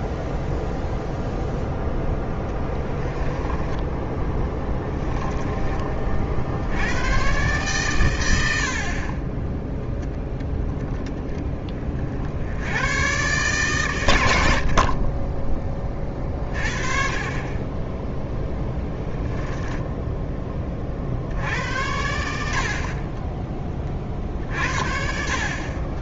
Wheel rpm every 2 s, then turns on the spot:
0, 10, 10, 80, 60, 10, 100, 50, 40, 0, 30, 60, 40.
2-6